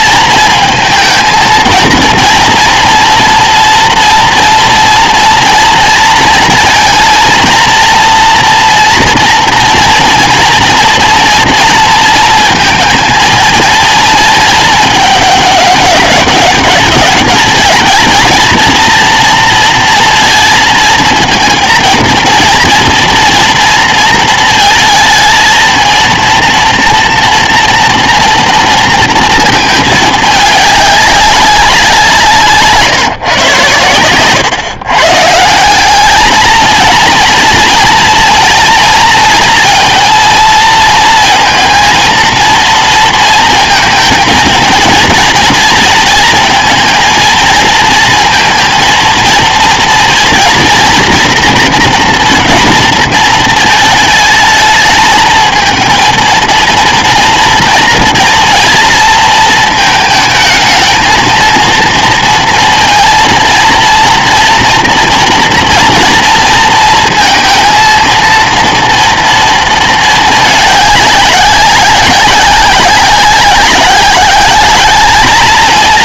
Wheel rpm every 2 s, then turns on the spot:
230, 240, 230, 230, 230, 230, 230, 220, 200, 220, 230, 230, 220, 230, 230, 210, 150, 130, 220, 230, 230, 230, 230, 230, 230, 240, 230, 220, 230, 230, 220, 230, 230, 230, 230, 210, 190, 200.
none